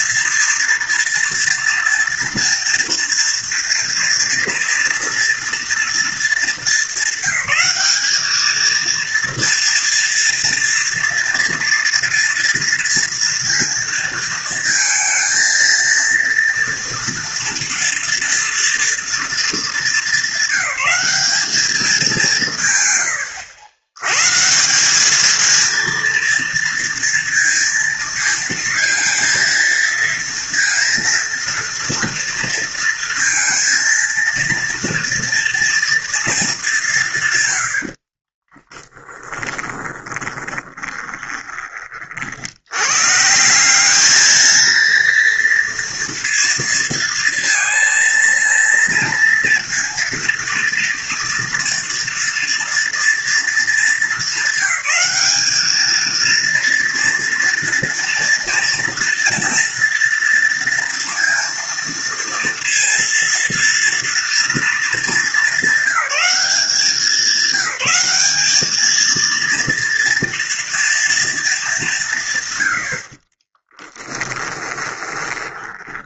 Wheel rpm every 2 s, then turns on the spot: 230, 230, 230, 200, 230, 230, 230, 230, 230, 230, 200, 100, 210, 230, 230, 230, 230, 230, 170, 10, 20, 140, 230, 230, 230, 230, 230, 200, 230, 240, 230, 230, 230, 190, 220, 230, 60, 20.
22-24 38-42 74-76